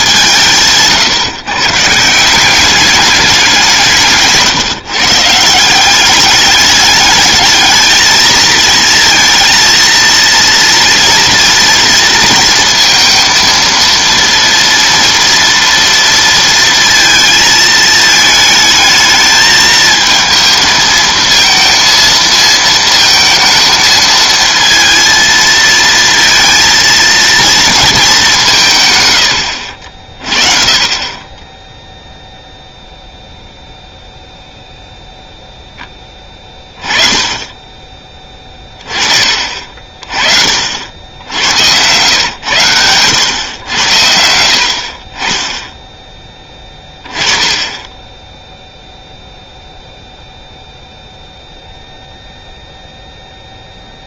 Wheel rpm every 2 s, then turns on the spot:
150, 190, 150, 210, 220, 230, 230, 230, 230, 220, 220, 230, 230, 230, 160, 40, 0, 0, 20, 20, 60, 110, 70, 20, 0, 0, 0.
40-42